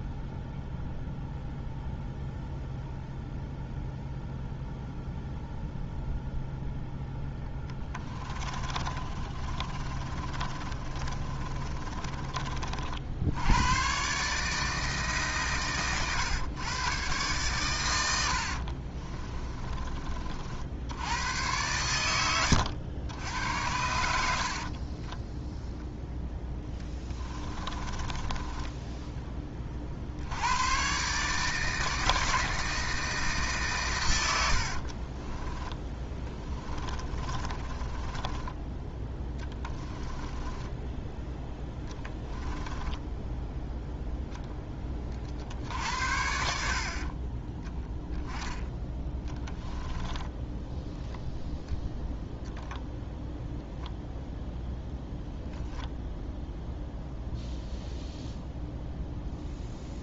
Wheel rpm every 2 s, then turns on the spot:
0, 0, 0, 0, 30, 30, 50, 150, 120, 50, 70, 90, 40, 10, 20, 130, 160, 60, 20, 10, 10, 10, 20, 60, 10, 10, 10, 0, 0, 0.
8-12 18-20 24-30 34-38 40-44